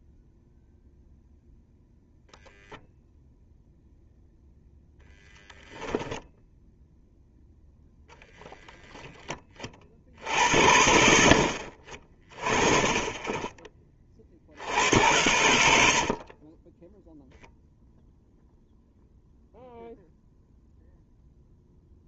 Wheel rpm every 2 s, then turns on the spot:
0, 0, 0, 0, 10, 70, 30, 70, 20, 0, 0.
16-18